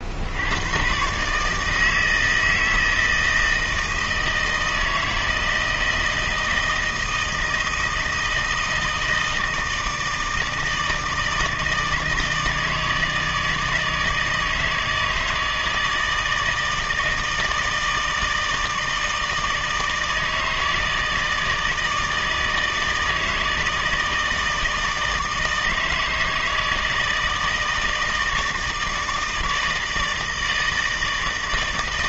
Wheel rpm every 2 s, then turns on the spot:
120, 160, 160, 160, 160, 160, 160, 160, 160, 160, 160, 160, 160, 160, 160, 160.
none